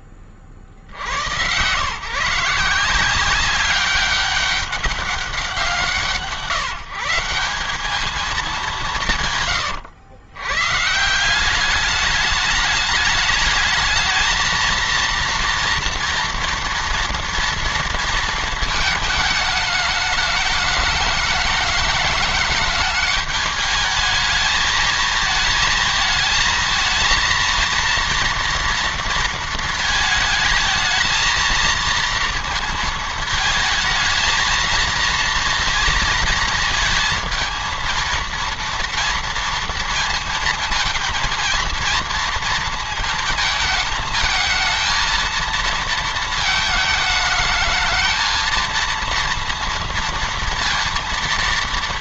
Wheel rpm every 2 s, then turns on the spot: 50, 170, 200, 170, 180, 140, 210, 230, 240, 220, 210, 210, 220, 220, 230, 220, 230, 230, 230, 230, 230, 230, 230, 220, 230, 230.
none